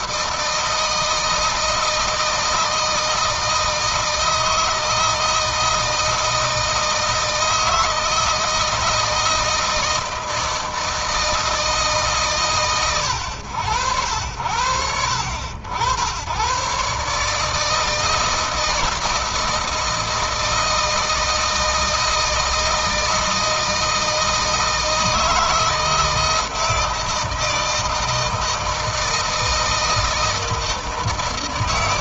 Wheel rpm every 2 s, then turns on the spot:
160, 160, 160, 160, 160, 160, 110, 80, 130, 160, 160, 160, 160, 160, 160, 160.
none